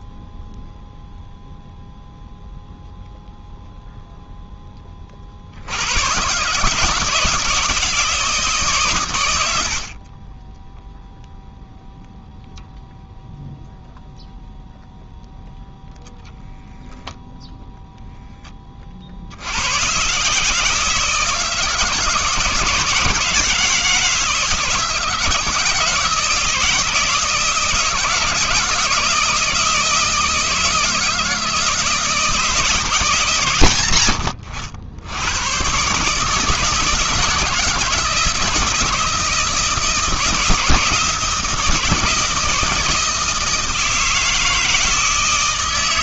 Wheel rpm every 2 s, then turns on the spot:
0, 0, 20, 150, 140, 10, 0, 0, 0, 20, 160, 160, 150, 160, 170, 160, 160, 70, 160, 160, 160, 160, 160.
none